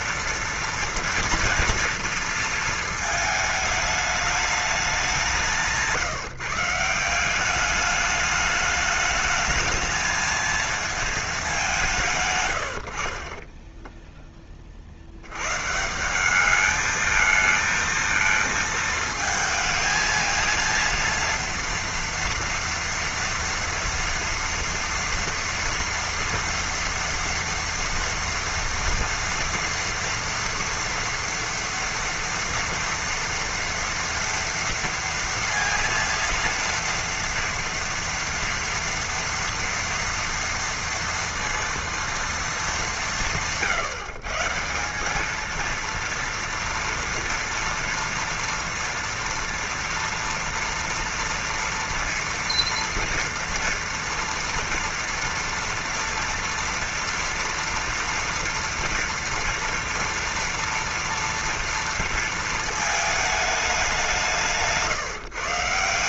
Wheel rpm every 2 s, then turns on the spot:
230, 230, 210, 160, 210, 220, 110, 20, 210, 220, 230, 230, 240, 230, 230, 230, 230, 230, 230, 230, 230, 210, 160, 240, 230, 230, 230, 230, 230, 230, 230, 220, 170.
none